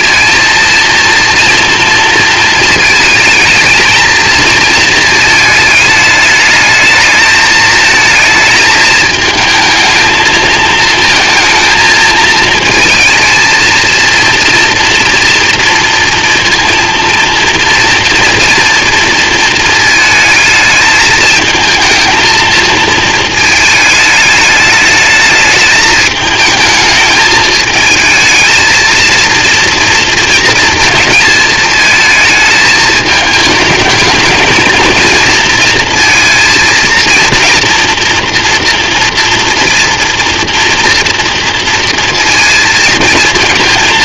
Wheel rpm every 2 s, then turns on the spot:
230, 230, 230, 220, 220, 220, 220, 230, 230, 230, 220, 230, 220, 220, 230, 230, 220, 230, 230, 240, 230, 230.
none